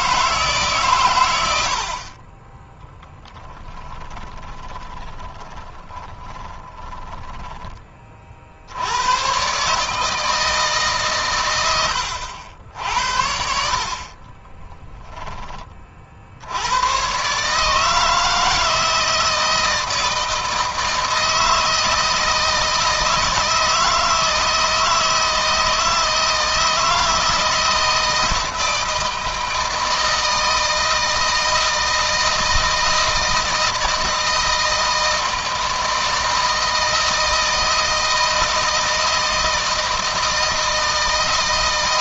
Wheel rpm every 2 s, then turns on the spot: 130, 10, 20, 10, 70, 150, 70, 20, 100, 160, 160, 160, 160, 160, 160, 160, 160, 160, 160, 160, 160.
2-8 14-16